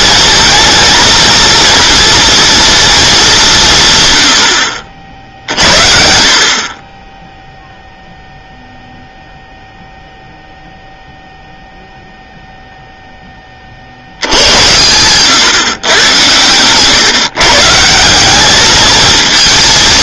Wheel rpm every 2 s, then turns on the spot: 230, 230, 70, 40, 0, 0, 0, 80, 120, 210.
none